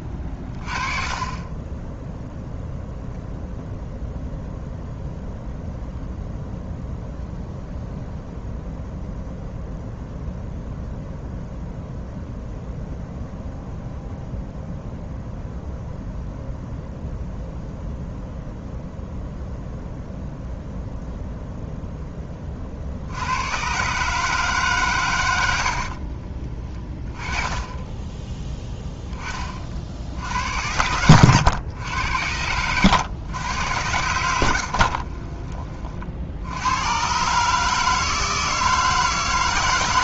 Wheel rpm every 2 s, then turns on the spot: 20, 0, 0, 0, 0, 0, 0, 0, 0, 0, 0, 40, 140, 20, 10, 80, 90, 70, 80, 160.
34-36